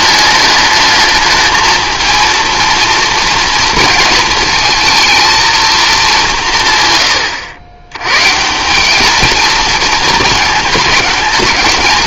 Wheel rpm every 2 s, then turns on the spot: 220, 230, 230, 130, 190, 210.
none